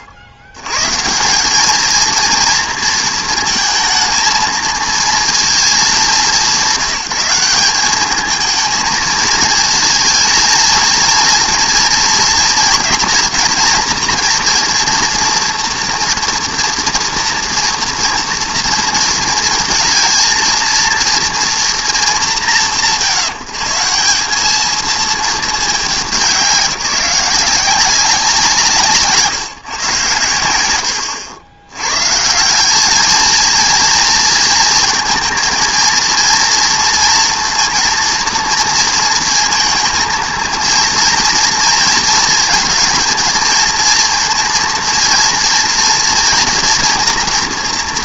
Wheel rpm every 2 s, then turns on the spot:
110, 230, 230, 190, 220, 230, 230, 230, 240, 230, 230, 150, 220, 180, 170, 80, 200, 230, 230, 230, 230, 230, 230, 230.
none